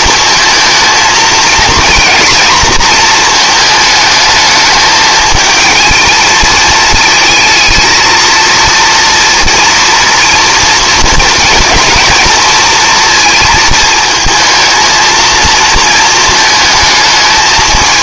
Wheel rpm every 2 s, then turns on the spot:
230, 230, 220, 220, 230, 220, 230, 220, 220.
none